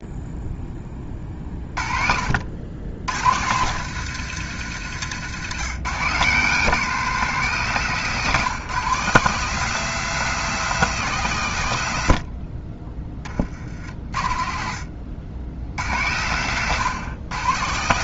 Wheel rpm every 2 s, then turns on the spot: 10, 90, 110, 180, 160, 180, 30, 50, 130.
4-6 14-16